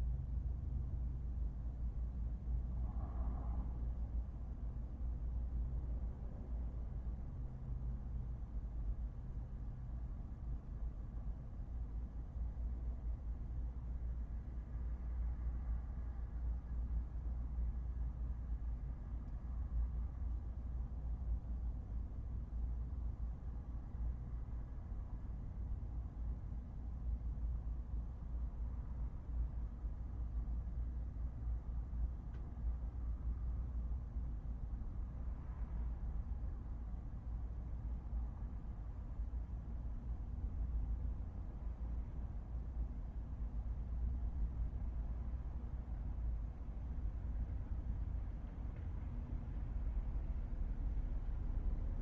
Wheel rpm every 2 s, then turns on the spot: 0, 0, 0, 0, 0, 0, 0, 0, 0, 0, 0, 0, 0, 0, 0, 0, 0, 0, 0, 0, 0, 0, 0, 0, 0, 0.
none